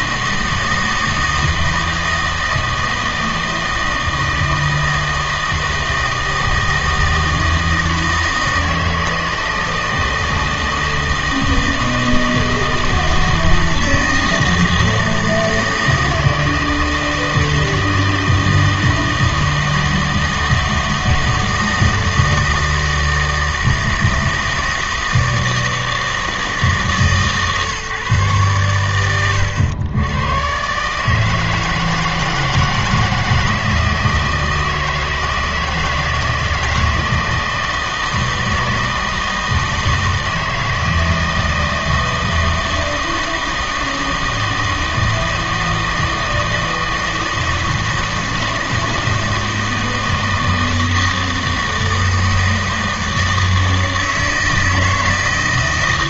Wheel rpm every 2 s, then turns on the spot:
160, 160, 160, 160, 160, 160, 160, 160, 160, 160, 160, 160, 160, 150, 110, 130, 160, 160, 160, 160, 160, 160, 160, 160, 160, 160, 160, 160.
none